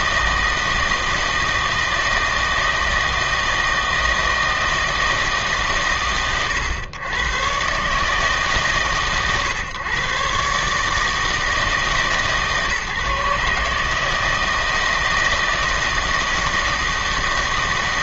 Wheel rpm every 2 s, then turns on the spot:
160, 160, 160, 120, 140, 140, 150, 160, 160.
none